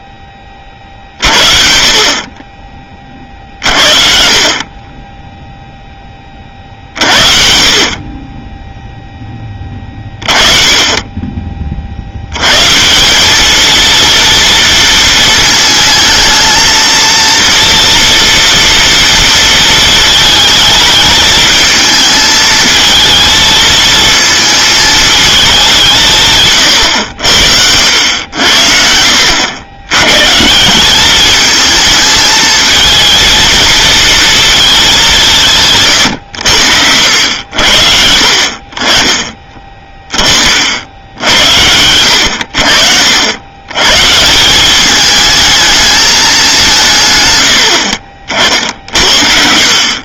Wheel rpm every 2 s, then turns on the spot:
50, 40, 10, 50, 10, 30, 210, 230, 230, 230, 220, 220, 210, 80, 80, 210, 230, 160, 80, 30, 80, 70, 210, 130, 80.
none